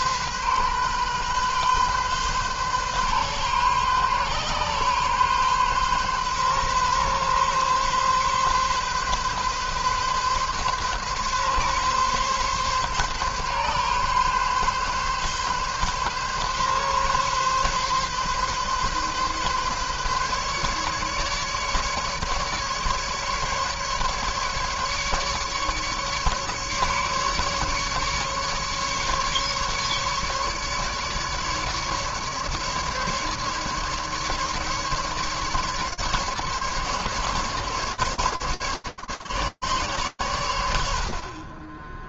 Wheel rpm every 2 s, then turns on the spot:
130, 130, 130, 130, 130, 130, 130, 140, 140, 140, 140, 150, 150, 150, 140, 150, 150, 140, 140, 150, 80.
none